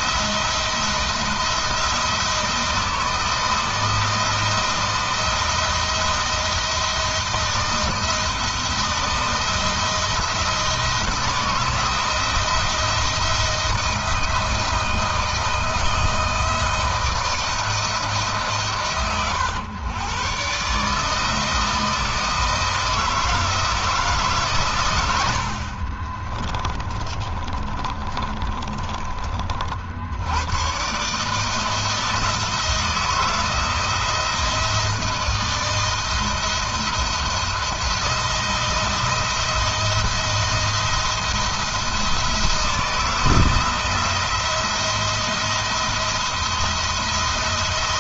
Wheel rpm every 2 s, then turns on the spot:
170, 160, 170, 170, 170, 160, 170, 160, 160, 110, 160, 160, 90, 30, 30, 140, 170, 160, 170, 170, 170, 160, 170, 170.
26-28